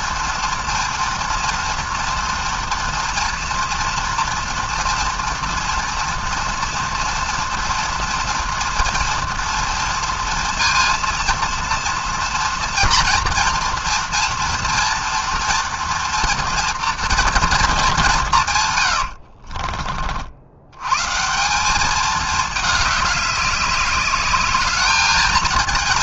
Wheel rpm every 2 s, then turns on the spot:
230, 230, 230, 230, 230, 230, 230, 230, 230, 120, 110, 210, 210.
18-20